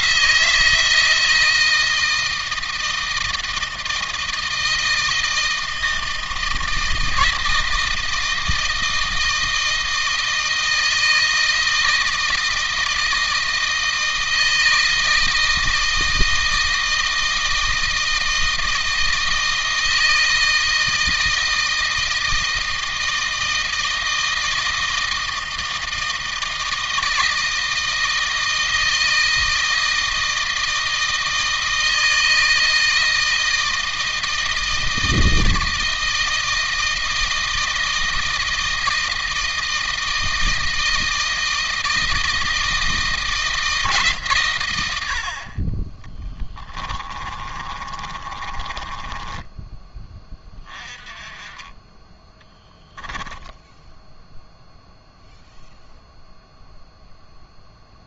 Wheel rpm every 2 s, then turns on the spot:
170, 160, 160, 160, 160, 160, 160, 160, 160, 160, 160, 160, 160, 160, 160, 160, 160, 160, 160, 160, 160, 160, 90, 30, 20, 20, 10, 0, 0.
46-50 52-54